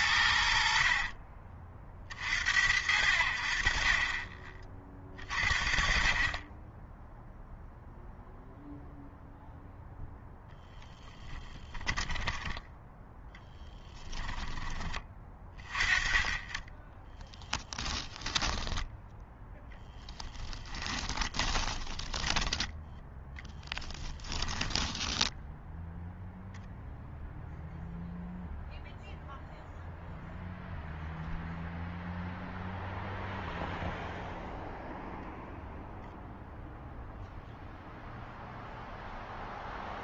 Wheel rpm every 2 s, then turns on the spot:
60, 60, 30, 10, 0, 10, 10, 20, 20, 10, 20, 10, 10, 0, 0, 0, 0, 0, 0, 0.
10-14 18-22 24-26